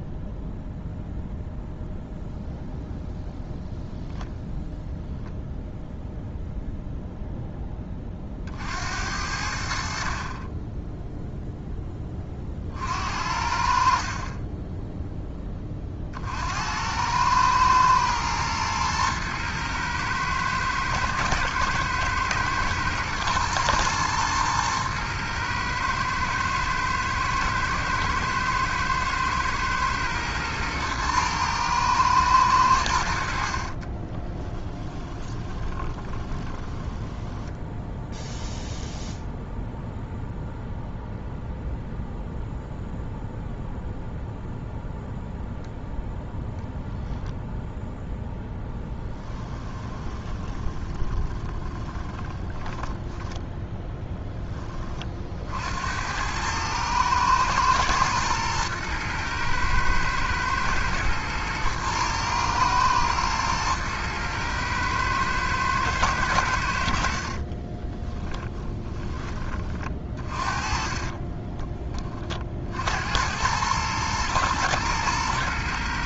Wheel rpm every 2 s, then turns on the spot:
0, 0, 0, 0, 50, 20, 40, 30, 70, 110, 110, 110, 110, 110, 110, 120, 100, 20, 20, 0, 0, 0, 0, 0, 0, 20, 10, 10, 100, 110, 110, 110, 110, 80, 20, 40, 40, 120.
34-38 50-54 68-72